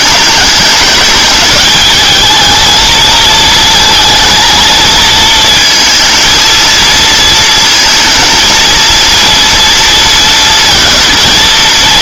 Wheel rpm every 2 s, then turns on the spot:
210, 220, 230, 230, 230, 230.
none